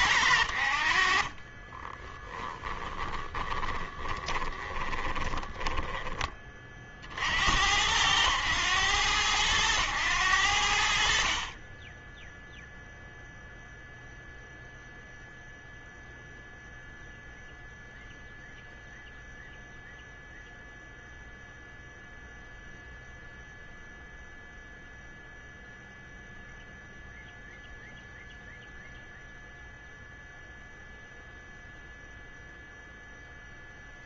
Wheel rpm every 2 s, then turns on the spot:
80, 30, 20, 30, 100, 90, 10, 0, 0, 0, 0, 0, 0, 0, 0, 0, 0.
2-6